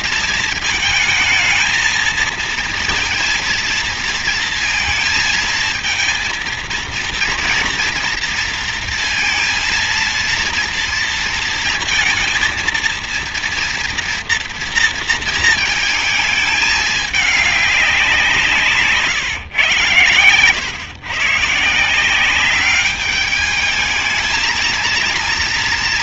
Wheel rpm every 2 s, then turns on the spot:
220, 230, 230, 230, 230, 230, 230, 230, 210, 150, 130, 200, 230.
none